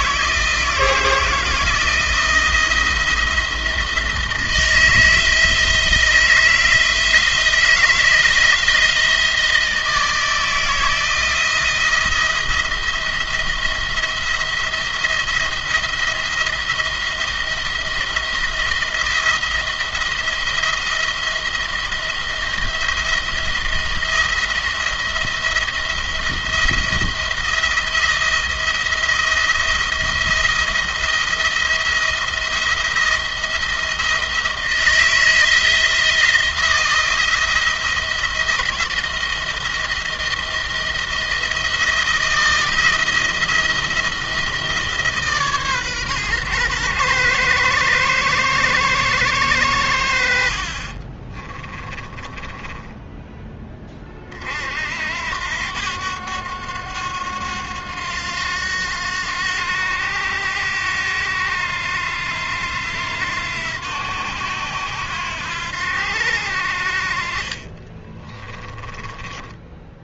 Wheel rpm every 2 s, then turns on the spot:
160, 170, 160, 170, 160, 170, 170, 170, 160, 170, 170, 170, 170, 170, 170, 170, 170, 160, 170, 170, 170, 170, 160, 130, 120, 50, 20, 50, 90, 90, 90, 90, 90, 70, 20.
50-54 68-70